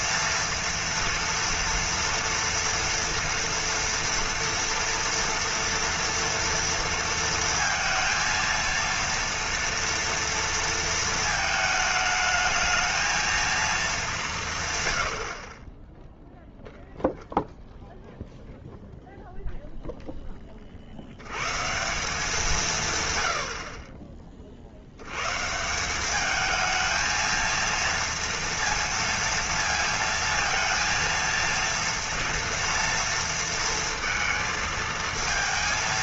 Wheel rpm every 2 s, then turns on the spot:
230, 230, 230, 230, 230, 230, 220, 140, 0, 0, 40, 160, 60, 220, 230, 230, 230, 230.
none